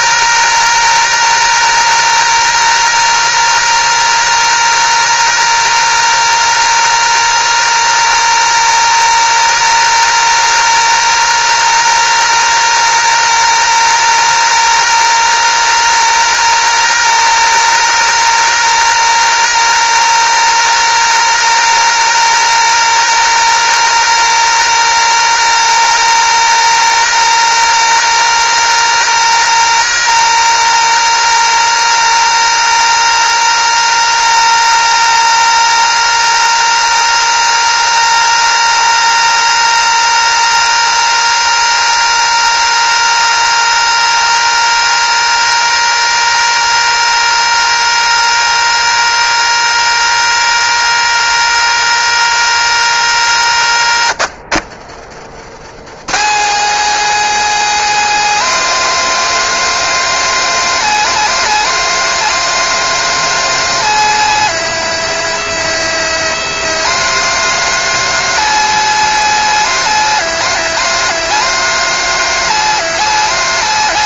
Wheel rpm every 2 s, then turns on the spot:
220, 220, 220, 220, 220, 220, 220, 220, 220, 220, 220, 220, 220, 220, 220, 220, 220, 220, 220, 220, 220, 220, 220, 220, 220, 220, 200, 130, 230, 240, 230, 240, 230, 230, 230, 240, 240.
54-56